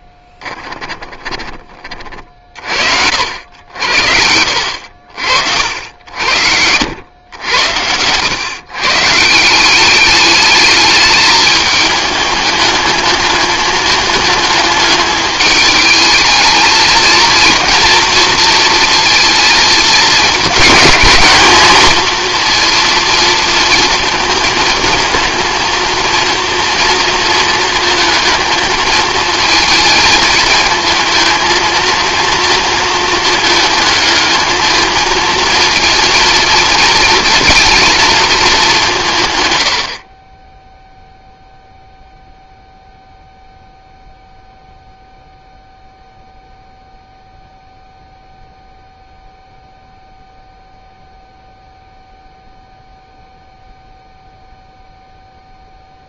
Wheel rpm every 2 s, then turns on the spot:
20, 50, 70, 100, 140, 210, 210, 220, 220, 230, 210, 230, 220, 230, 220, 220, 220, 220, 230, 190, 0, 0, 0, 0, 0, 0, 0, 0.
0-2 4-6